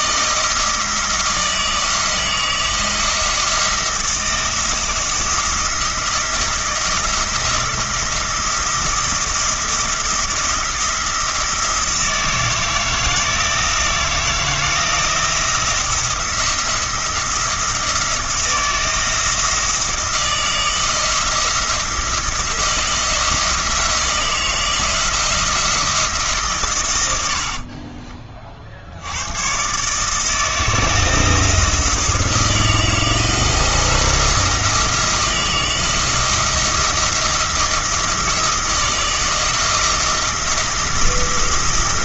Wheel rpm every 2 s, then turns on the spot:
160, 170, 170, 170, 170, 170, 160, 170, 170, 160, 160, 170, 170, 120, 70, 170, 170, 170, 170, 160, 170.
none